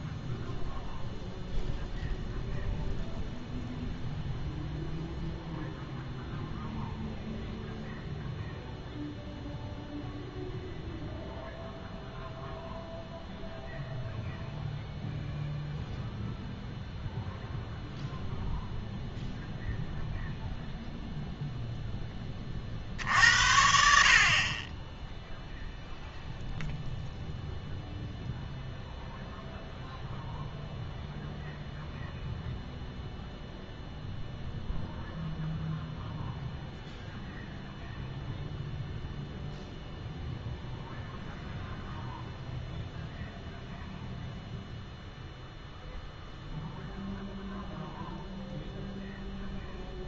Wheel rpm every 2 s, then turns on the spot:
0, 0, 0, 0, 0, 0, 0, 0, 0, 0, 0, 50, 20, 0, 0, 0, 0, 0, 0, 0, 0, 0, 0, 0, 0.
none